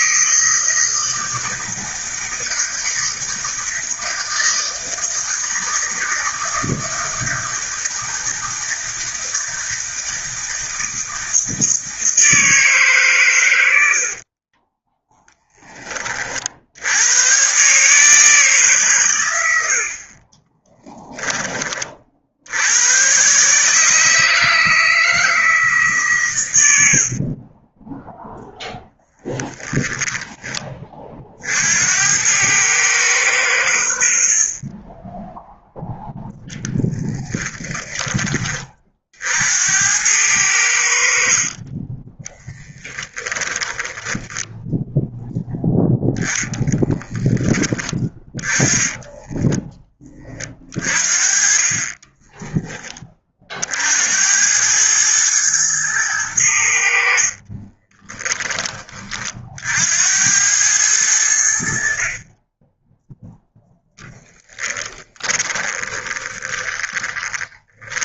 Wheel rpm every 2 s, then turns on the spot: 160, 160, 160, 160, 160, 160, 140, 20, 90, 130, 10, 120, 160, 80, 10, 40, 110, 20, 0, 50, 60, 10, 10, 30, 10, 40, 20, 110, 70, 40, 90, 0, 20, 30.
14-16 26-28 34-36 40-44 46-50 56-58 64-68